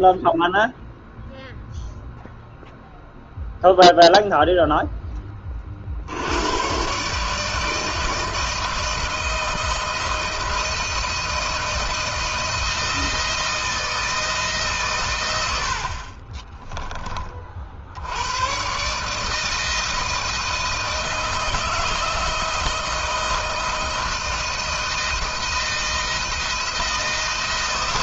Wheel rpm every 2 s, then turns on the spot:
0, 0, 0, 110, 160, 170, 160, 130, 20, 130, 160, 160, 160, 170.
none